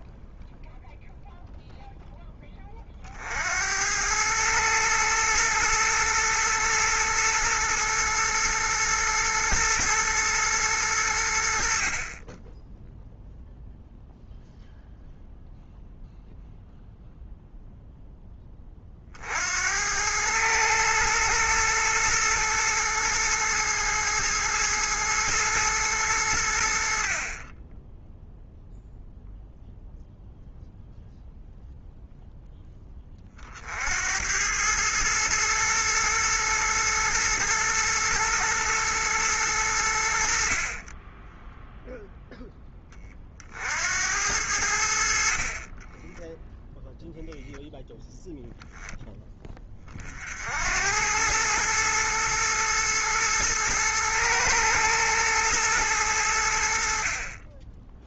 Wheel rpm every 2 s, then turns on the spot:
0, 20, 110, 110, 110, 110, 10, 0, 0, 20, 110, 110, 110, 80, 0, 0, 10, 100, 120, 110, 50, 10, 80, 0, 0, 70, 110, 110, 70.
none